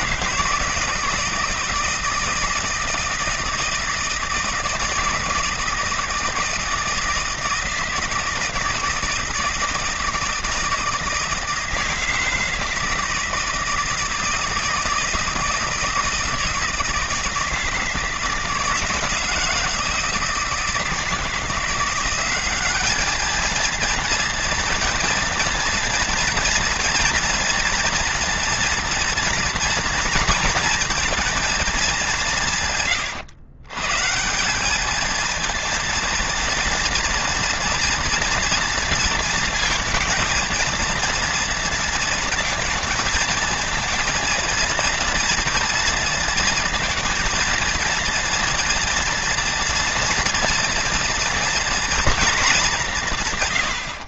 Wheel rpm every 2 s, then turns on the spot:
170, 170, 160, 160, 160, 160, 160, 160, 160, 160, 170, 210, 230, 230, 230, 230, 120, 220, 240, 230, 230, 230, 230, 230, 230, 230, 170.
none